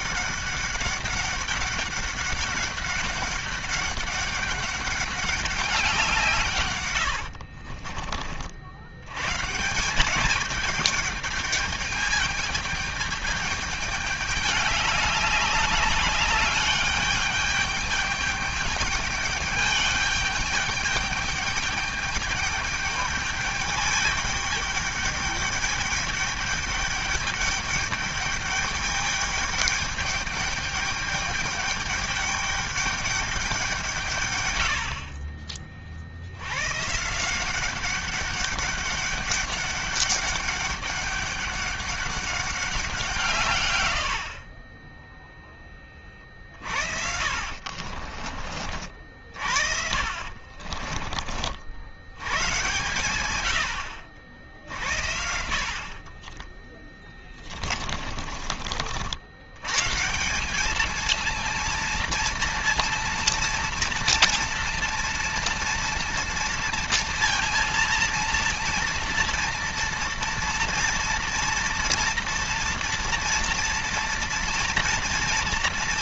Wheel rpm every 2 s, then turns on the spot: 200, 200, 200, 140, 60, 210, 210, 210, 210, 210, 210, 210, 210, 210, 210, 210, 210, 100, 100, 200, 200, 200, 60, 50, 40, 50, 110, 70, 30, 40, 180, 230, 230, 230, 230, 230, 230, 230.
6-8 44-48 50-52 56-58